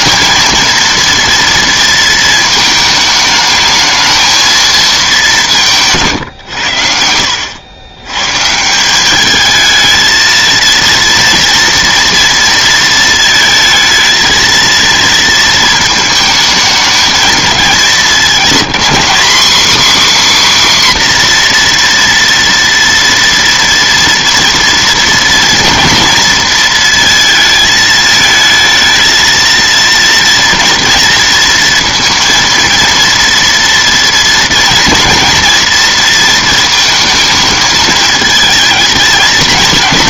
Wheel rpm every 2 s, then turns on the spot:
230, 220, 210, 80, 190, 230, 230, 230, 220, 230, 260, 230, 230, 230, 230, 230, 230, 240, 220, 220.
6-8